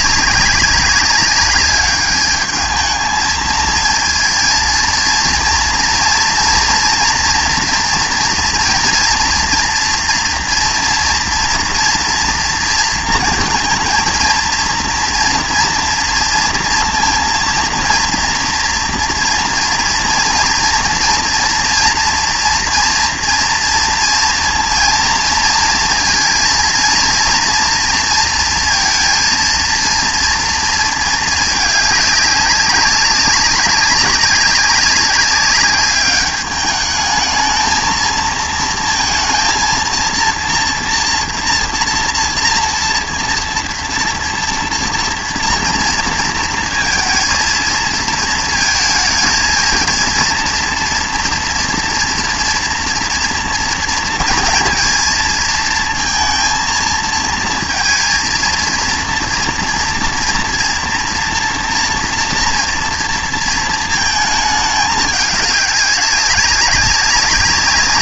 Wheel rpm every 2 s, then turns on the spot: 200, 210, 230, 230, 230, 230, 230, 230, 230, 230, 230, 230, 230, 230, 230, 230, 200, 190, 210, 220, 230, 230, 230, 230, 220, 230, 240, 230, 230, 230, 230, 230, 220, 200.
none